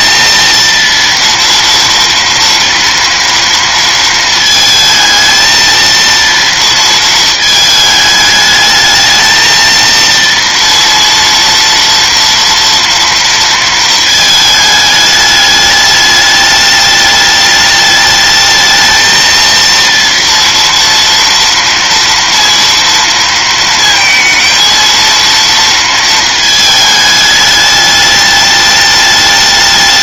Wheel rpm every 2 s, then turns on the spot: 230, 230, 220, 230, 220, 230, 230, 220, 210, 220, 230, 230, 230, 220, 210.
none